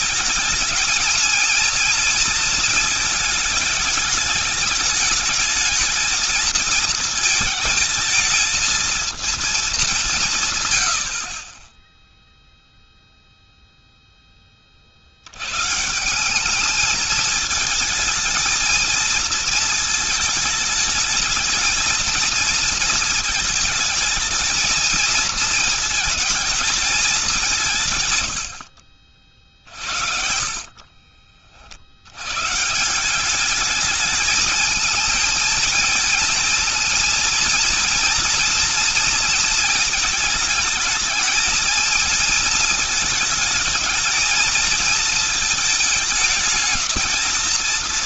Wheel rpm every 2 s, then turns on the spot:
220, 220, 220, 220, 230, 110, 0, 40, 210, 220, 220, 220, 220, 220, 90, 50, 150, 220, 230, 230, 220, 220, 220, 220.
28-32